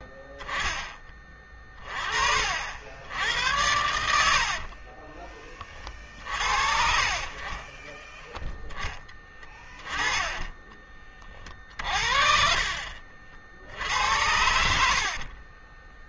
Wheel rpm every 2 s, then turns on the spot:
20, 70, 40, 40, 10, 30, 50, 70.
4-6 14-16